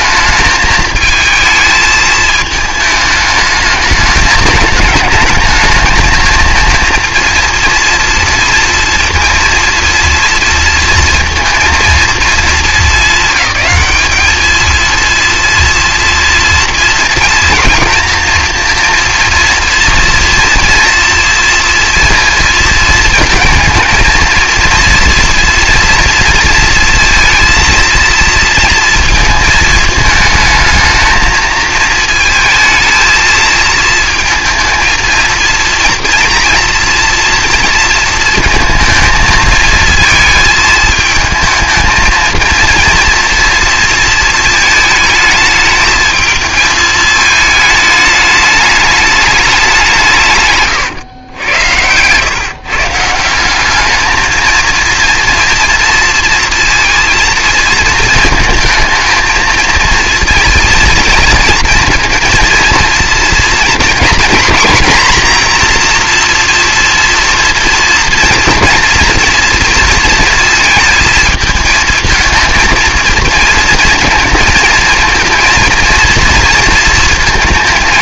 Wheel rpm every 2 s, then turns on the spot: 220, 210, 220, 230, 230, 230, 210, 230, 230, 230, 240, 230, 230, 230, 230, 220, 230, 230, 230, 220, 220, 240, 220, 220, 210, 130, 150, 230, 230, 220, 230, 230, 240, 230, 230, 220, 230, 230, 230.
50-52